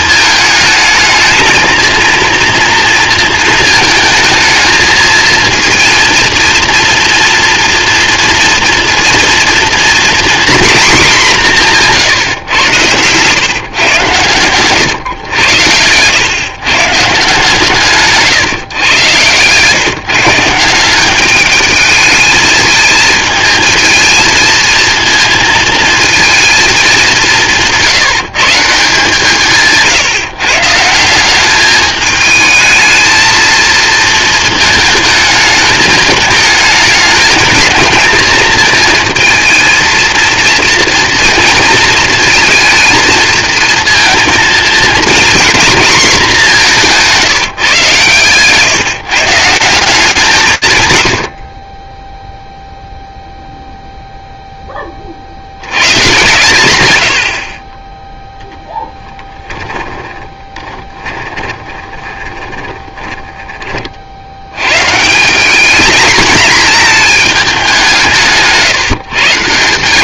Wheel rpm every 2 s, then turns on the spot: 220, 230, 220, 230, 230, 240, 110, 120, 140, 140, 170, 220, 230, 220, 160, 150, 220, 220, 220, 230, 230, 230, 230, 200, 150, 140, 0, 10, 120, 0, 20, 20, 110, 220, 140.
60-64 68-70